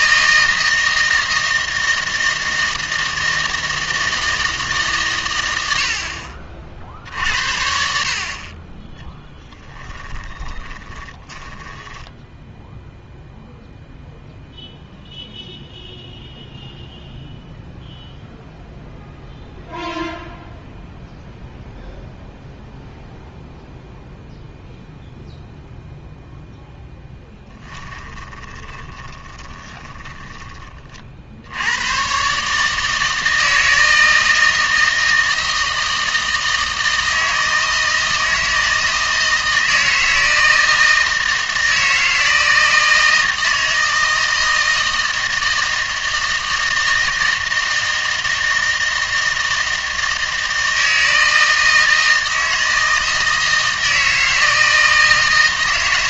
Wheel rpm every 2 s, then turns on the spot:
160, 160, 140, 50, 30, 20, 0, 0, 0, 0, 0, 0, 0, 10, 10, 30, 150, 160, 160, 160, 160, 160, 160, 160, 160, 160, 160, 160.
8-12 28-30